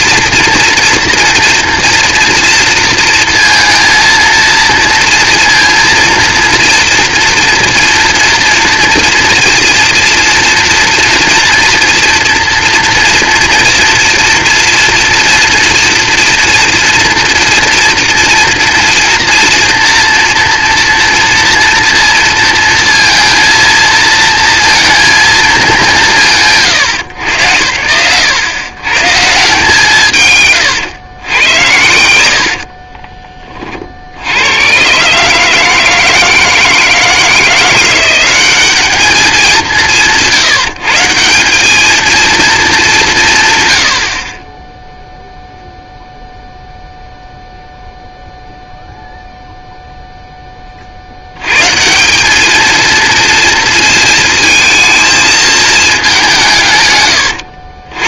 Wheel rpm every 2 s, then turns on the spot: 240, 230, 230, 230, 230, 230, 230, 230, 230, 230, 230, 230, 230, 180, 80, 140, 60, 90, 160, 190, 130, 220, 30, 0, 0, 20, 210, 220, 190.
32-34